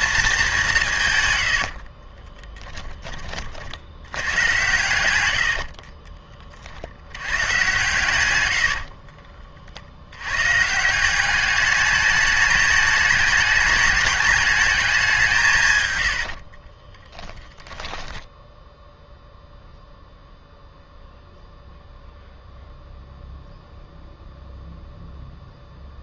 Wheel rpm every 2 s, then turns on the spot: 190, 10, 100, 50, 90, 140, 210, 210, 40, 10, 0, 0, 0.
8-10 16-18